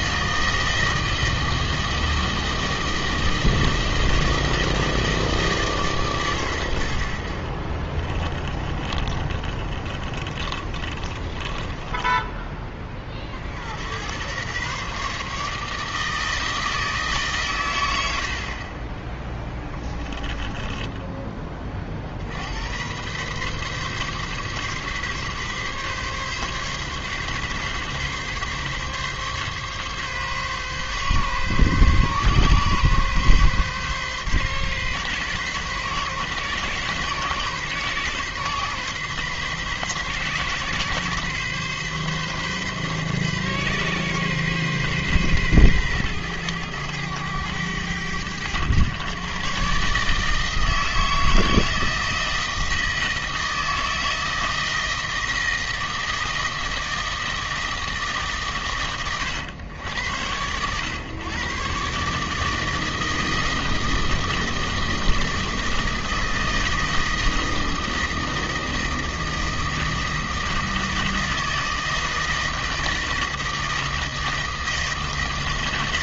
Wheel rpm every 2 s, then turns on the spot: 160, 160, 160, 100, 20, 30, 20, 120, 160, 40, 10, 90, 140, 140, 140, 130, 130, 130, 130, 130, 130, 130, 130, 110, 110, 160, 160, 160, 160, 130, 110, 160, 160, 160, 160, 160, 160, 160.
8-12 20-22